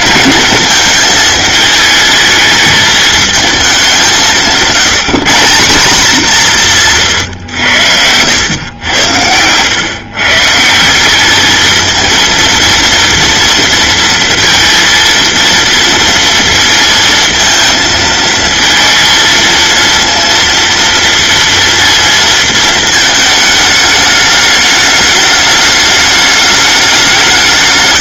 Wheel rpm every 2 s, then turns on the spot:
220, 220, 160, 130, 100, 200, 230, 230, 230, 230, 230, 220, 210, 200.
none